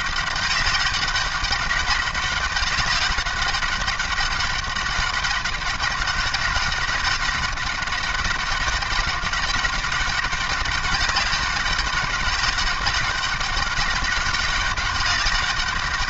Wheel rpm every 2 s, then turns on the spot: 200, 200, 200, 200, 200, 200, 200, 200.
none